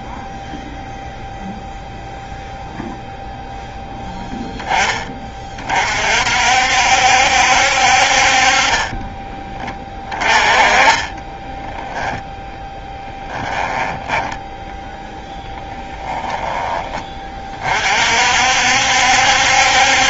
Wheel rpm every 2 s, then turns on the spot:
0, 0, 10, 60, 30, 20, 0, 0, 10, 60.
10-12